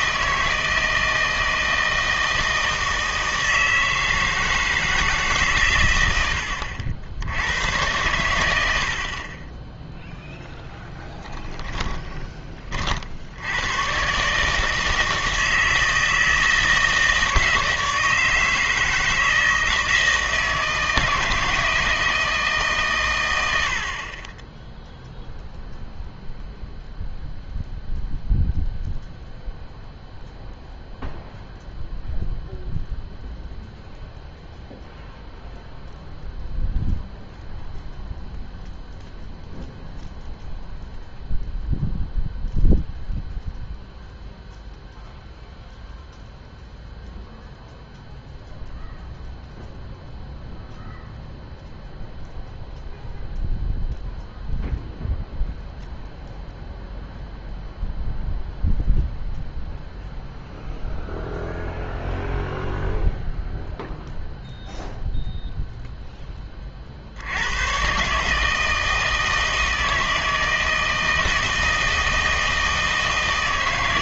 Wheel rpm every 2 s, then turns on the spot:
160, 160, 160, 70, 90, 20, 40, 160, 160, 160, 160, 140, 0, 0, 0, 0, 0, 0, 0, 0, 0, 0, 0, 0, 0, 0, 0, 0, 0, 0, 0, 0, 0, 40, 160, 160, 160.
8-12